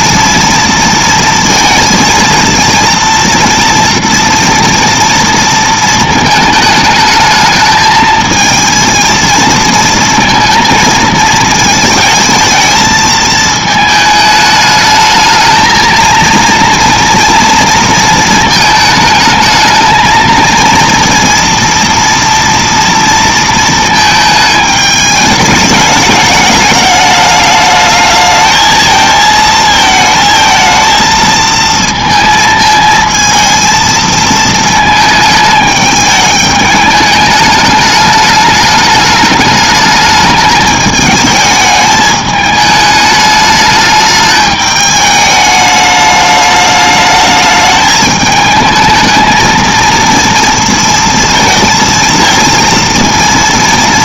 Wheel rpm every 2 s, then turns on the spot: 230, 230, 230, 220, 230, 220, 220, 220, 230, 220, 230, 220, 210, 210, 220, 230, 230, 210, 210, 210, 210, 210, 210, 210, 220, 230, 230.
none